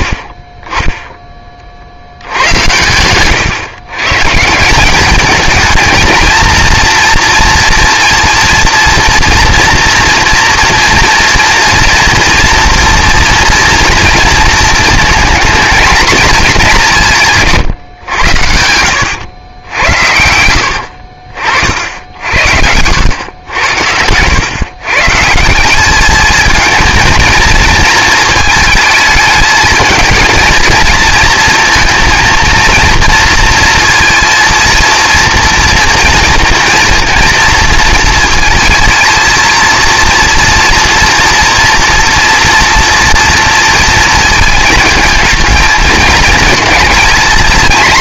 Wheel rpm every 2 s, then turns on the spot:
20, 100, 170, 230, 230, 230, 230, 230, 200, 90, 80, 80, 130, 220, 210, 220, 230, 230, 230, 230, 230, 230, 220, 220.
none